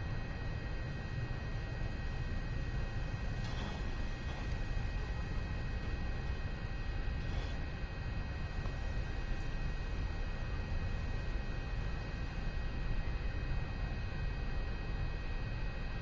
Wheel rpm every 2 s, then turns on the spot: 0, 0, 0, 0, 0, 0, 0, 0.
none